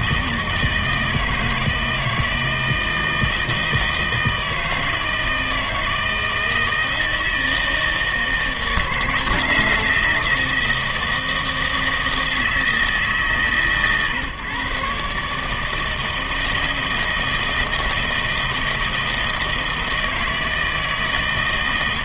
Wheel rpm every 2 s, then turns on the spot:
160, 160, 160, 160, 160, 160, 160, 140, 160, 160, 160.
none